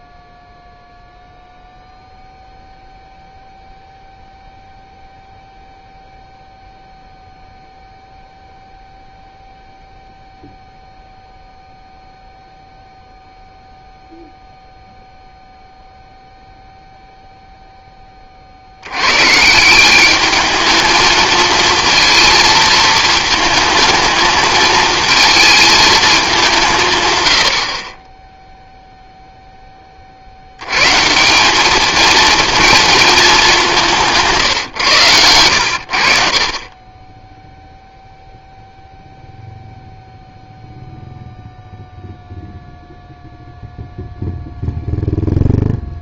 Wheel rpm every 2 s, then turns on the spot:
0, 0, 0, 0, 0, 0, 0, 0, 0, 80, 210, 220, 220, 160, 0, 110, 230, 130, 30, 0, 0, 0, 0.
none